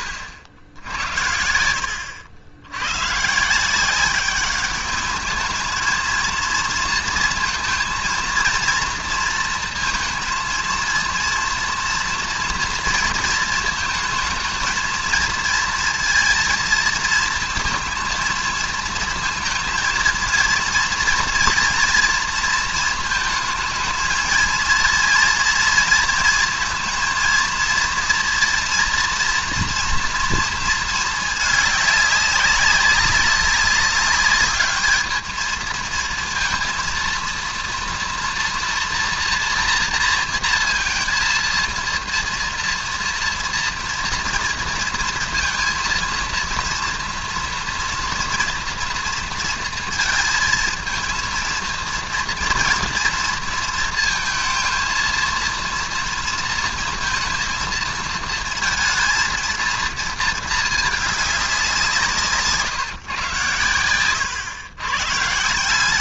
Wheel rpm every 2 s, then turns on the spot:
80, 100, 200, 230, 230, 230, 230, 230, 230, 230, 230, 230, 230, 230, 230, 230, 190, 210, 230, 230, 230, 230, 230, 230, 230, 220, 230, 230, 230, 230, 210, 150, 120.
0-2